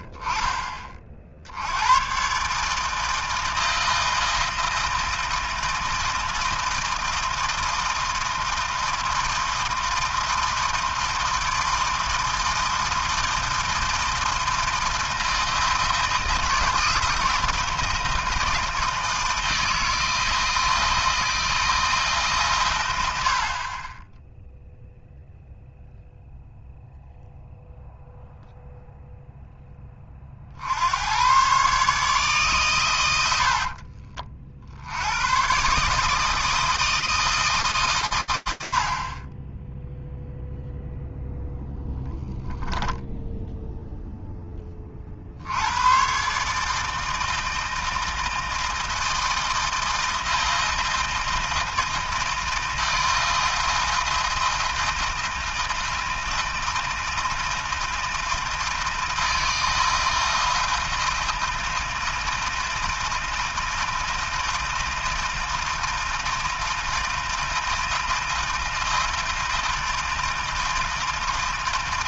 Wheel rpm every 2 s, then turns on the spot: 30, 140, 160, 160, 160, 160, 160, 160, 160, 160, 160, 120, 0, 0, 0, 100, 100, 90, 160, 20, 0, 10, 50, 160, 160, 160, 160, 160, 160, 160, 160, 160, 160, 160, 160, 160.
42-44